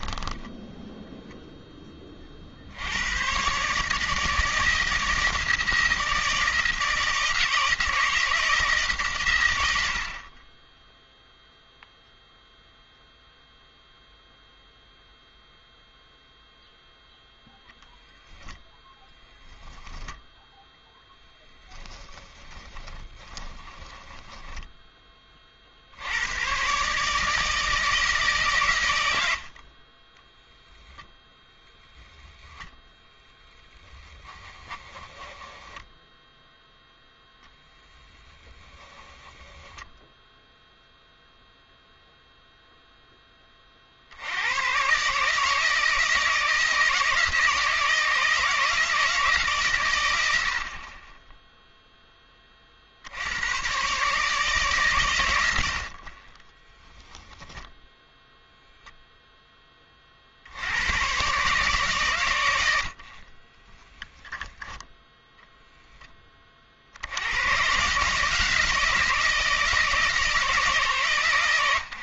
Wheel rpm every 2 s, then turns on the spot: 0, 80, 160, 160, 150, 10, 0, 0, 0, 0, 0, 10, 10, 130, 120, 0, 0, 10, 0, 10, 0, 0, 120, 160, 160, 40, 50, 130, 10, 0, 90, 80, 0, 50, 160, 150.
22-24 34-36 38-40 56-58